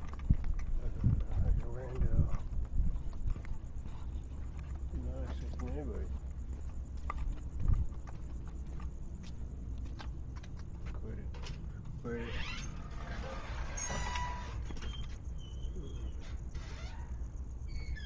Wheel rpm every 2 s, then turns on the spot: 0, 0, 0, 0, 0, 0, 0, 0, 0.
none